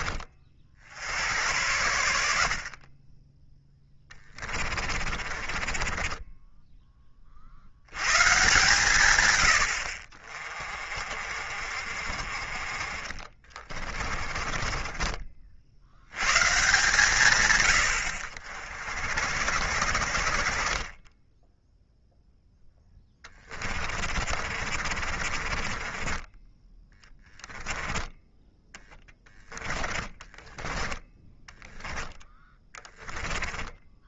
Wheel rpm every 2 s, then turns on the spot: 60, 40, 30, 20, 140, 40, 40, 30, 140, 60, 30, 10, 40, 10, 10, 10, 20.
4-6 12-16 22-28 30-34